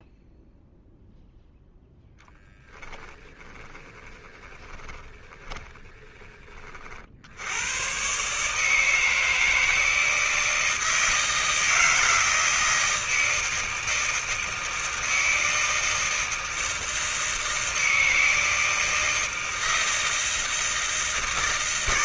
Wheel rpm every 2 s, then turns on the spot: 0, 10, 20, 20, 130, 160, 160, 160, 160, 160, 160.
2-6